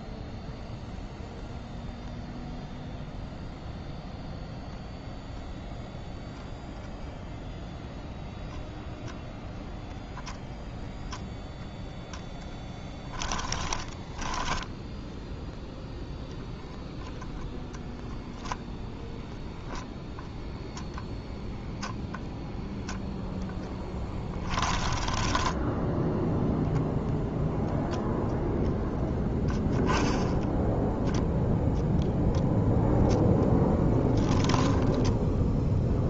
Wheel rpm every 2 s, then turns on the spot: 0, 0, 0, 0, 0, 0, 10, 10, 0, 0, 0, 0, 10, 10, 0, 0, 0, 10.
24-28 34-36